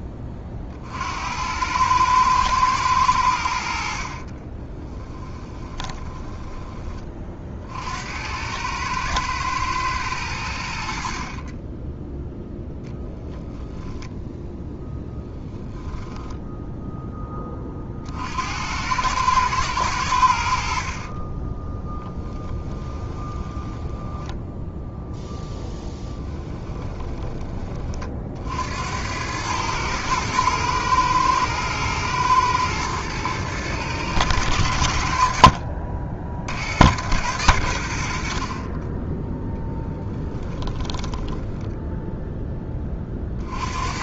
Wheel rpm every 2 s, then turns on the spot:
40, 100, 30, 20, 110, 70, 0, 0, 10, 90, 60, 20, 10, 10, 70, 120, 110, 80, 90, 20, 10, 20.
4-6 22-24 26-28 40-42